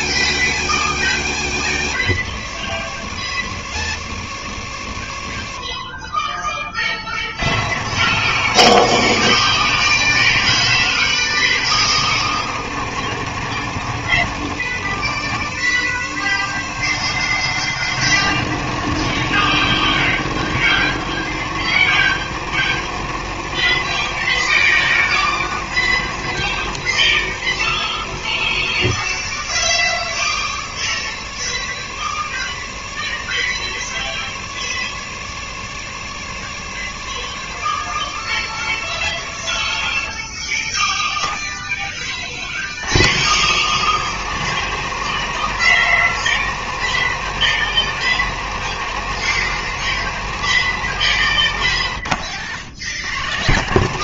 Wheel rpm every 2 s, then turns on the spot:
100, 80, 50, 40, 100, 90, 90, 80, 90, 100, 90, 90, 100, 70, 70, 80, 70, 70, 70, 60, 10, 70, 100, 100, 100, 90, 100.
none